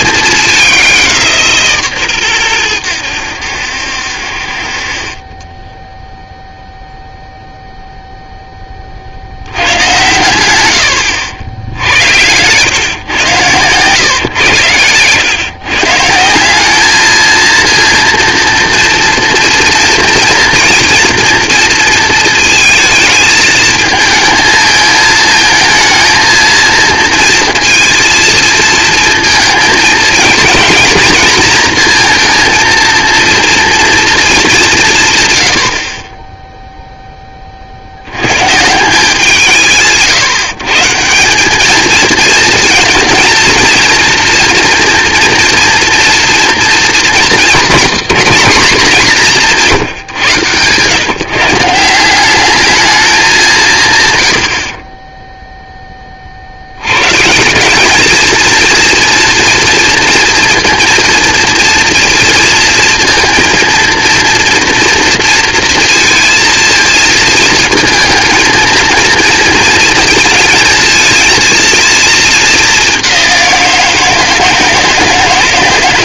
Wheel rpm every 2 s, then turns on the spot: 210, 110, 50, 0, 40, 90, 110, 110, 210, 230, 240, 220, 220, 230, 230, 230, 230, 150, 0, 160, 160, 230, 230, 230, 200, 120, 210, 50, 70, 230, 230, 230, 230, 220, 220, 220, 210, 160.
none